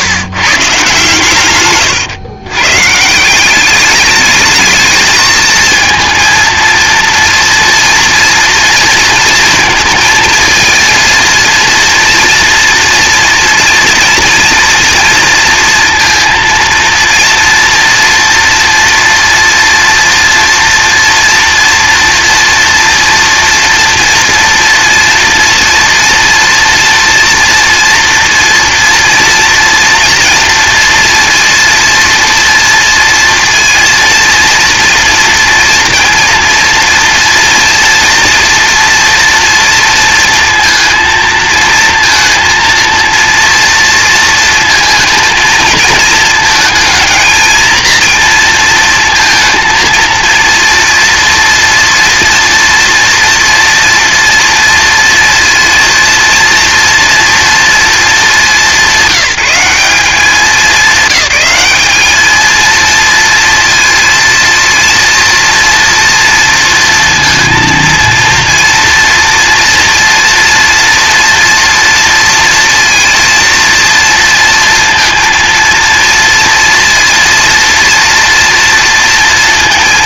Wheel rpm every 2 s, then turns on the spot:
130, 130, 220, 230, 230, 230, 230, 230, 230, 230, 230, 230, 230, 230, 240, 230, 230, 230, 230, 230, 230, 230, 230, 220, 230, 230, 240, 230, 230, 190, 190, 230, 230, 230, 230, 240, 230, 230, 230, 230.
none